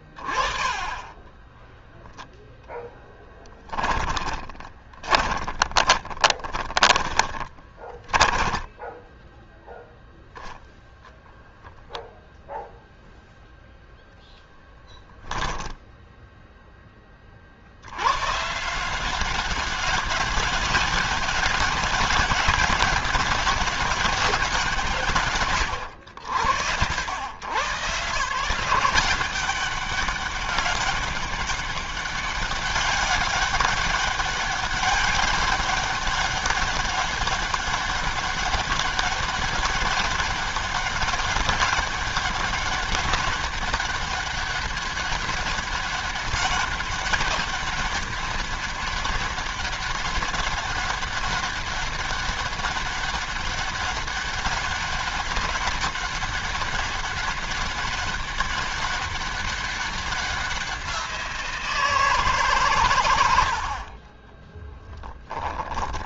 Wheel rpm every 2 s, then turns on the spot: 20, 10, 20, 20, 10, 0, 0, 10, 50, 190, 190, 200, 130, 90, 190, 200, 200, 200, 200, 200, 200, 200, 200, 200, 200, 200, 200, 200, 200, 200, 180, 130, 0.
0-8 14-16